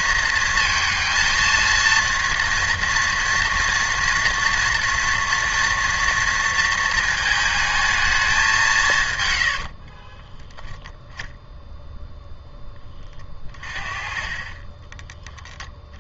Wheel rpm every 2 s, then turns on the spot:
230, 230, 230, 230, 190, 10, 10, 20.
none